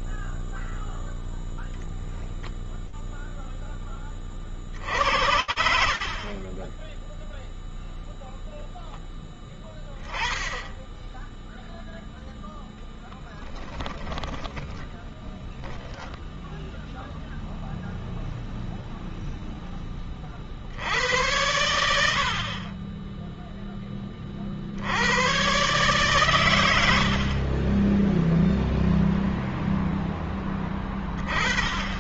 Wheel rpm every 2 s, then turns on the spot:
0, 0, 60, 20, 0, 0, 10, 0, 0, 0, 80, 0, 110, 40, 0, 20.
12-14